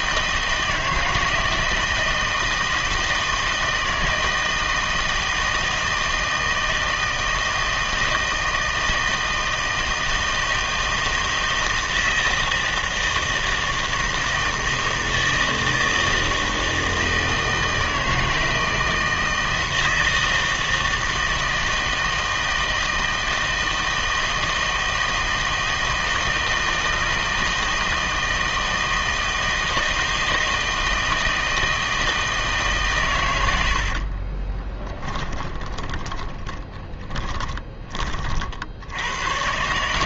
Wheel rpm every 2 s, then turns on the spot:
160, 160, 160, 160, 160, 160, 160, 160, 160, 160, 160, 160, 160, 160, 160, 160, 150, 20, 20, 80.
34-38